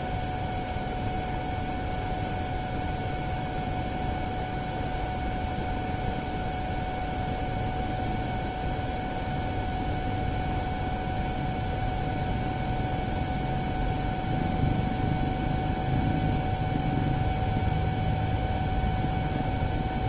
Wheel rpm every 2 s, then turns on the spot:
0, 0, 0, 0, 0, 0, 0, 0, 0, 0.
none